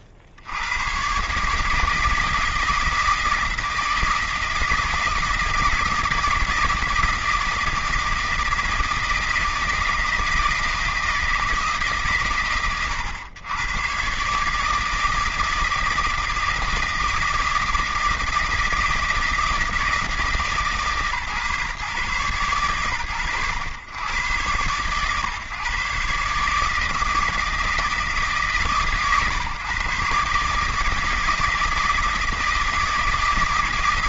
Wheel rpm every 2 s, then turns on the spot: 90, 160, 170, 160, 160, 160, 90, 150, 160, 160, 150, 120, 90, 150, 140, 150, 160.
none